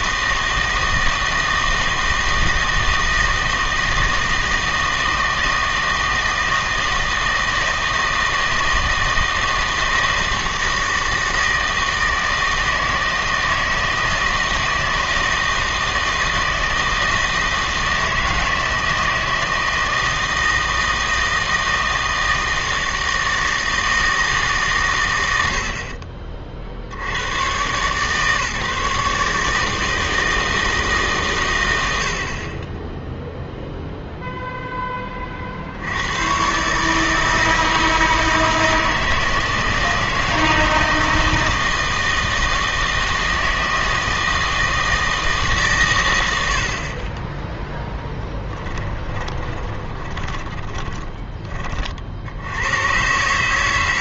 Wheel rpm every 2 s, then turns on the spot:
160, 160, 160, 160, 160, 160, 160, 160, 160, 160, 160, 160, 130, 60, 150, 160, 20, 10, 140, 160, 160, 160, 160, 60, 20, 20, 90.
48-52